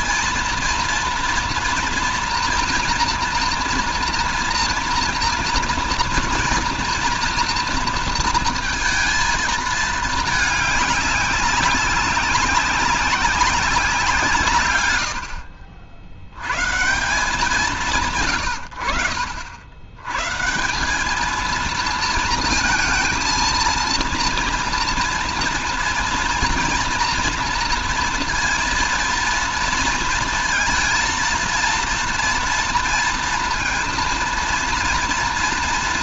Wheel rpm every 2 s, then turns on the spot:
230, 240, 240, 230, 230, 210, 190, 140, 130, 100, 160, 230, 230, 230, 230, 230, 230, 230.
none